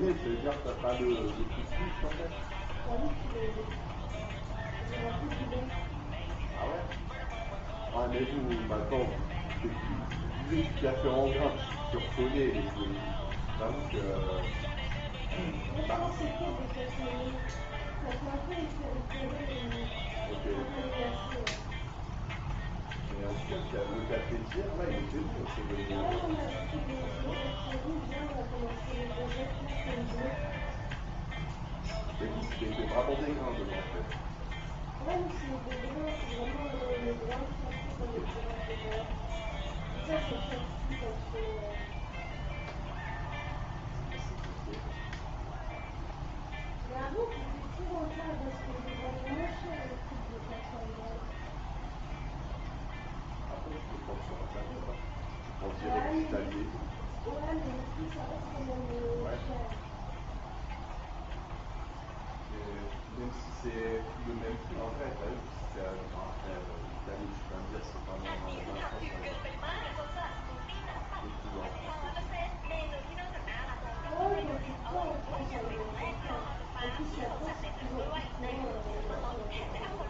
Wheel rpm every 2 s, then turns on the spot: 0, 0, 0, 0, 0, 0, 0, 0, 0, 0, 0, 0, 0, 0, 0, 0, 0, 0, 0, 0, 0, 0, 0, 0, 0, 0, 0, 0, 0, 0, 0, 0, 0, 0, 0, 0, 0, 0, 0, 0.
none